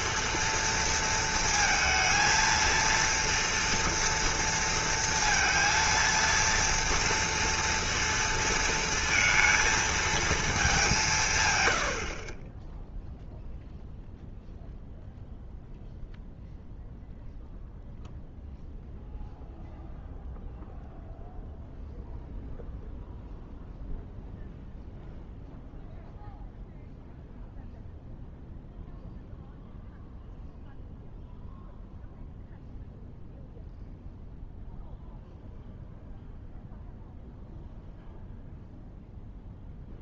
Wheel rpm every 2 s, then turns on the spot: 230, 230, 230, 230, 230, 210, 10, 0, 0, 0, 0, 0, 0, 0, 0, 0, 0, 0, 0, 0.
none